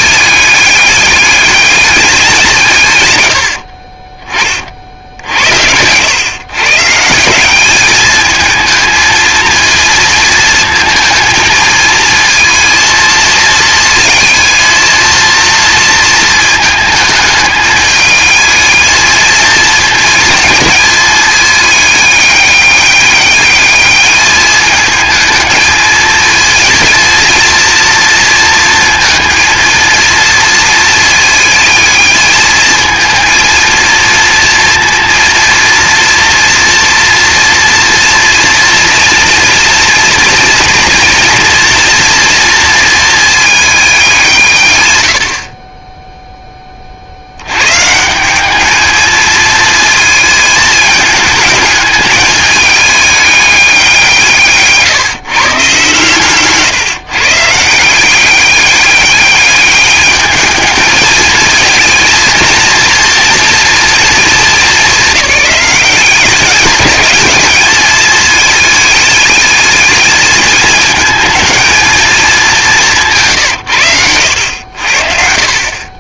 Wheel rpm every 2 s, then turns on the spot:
200, 140, 50, 140, 220, 230, 230, 230, 220, 220, 220, 200, 220, 230, 230, 220, 220, 230, 230, 230, 240, 230, 120, 30, 210, 220, 210, 150, 150, 200, 220, 230, 210, 210, 210, 220, 190, 70.
none